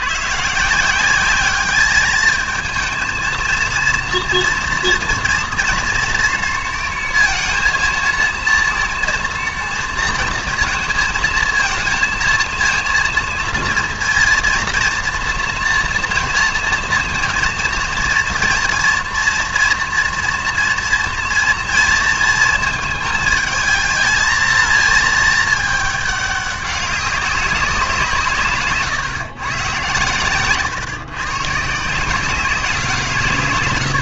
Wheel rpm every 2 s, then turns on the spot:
160, 220, 230, 230, 230, 230, 220, 230, 230, 240, 230, 230, 230, 200, 140, 130, 180.
28-32